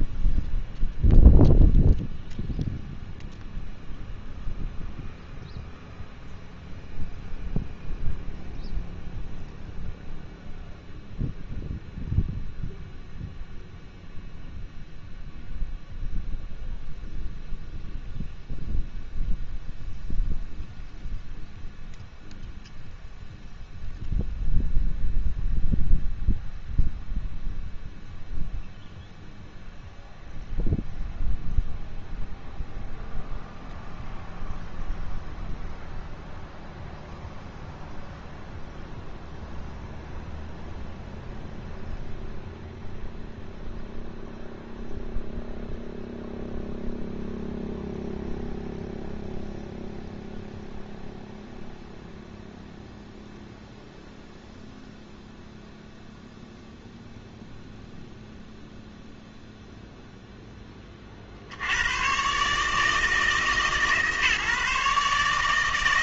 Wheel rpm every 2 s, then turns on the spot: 0, 0, 0, 0, 0, 0, 0, 0, 0, 0, 0, 0, 0, 0, 0, 0, 0, 0, 0, 0, 0, 0, 0, 0, 0, 0, 0, 0, 0, 0, 10, 150, 140.
none